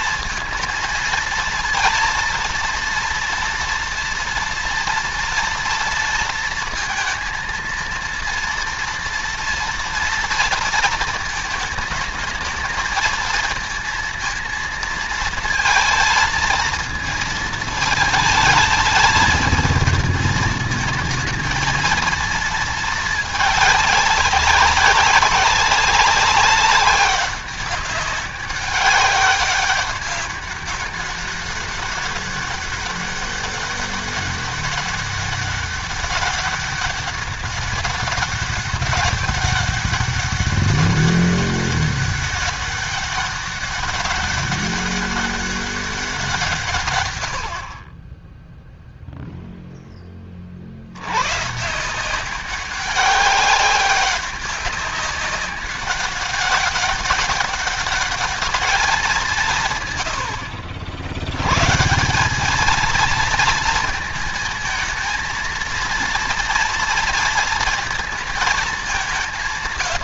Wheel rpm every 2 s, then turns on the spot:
230, 230, 230, 230, 230, 230, 220, 230, 220, 220, 220, 220, 200, 190, 200, 200, 200, 200, 200, 200, 200, 200, 200, 140, 0, 70, 190, 200, 200, 200, 70, 210, 230, 230, 200.
none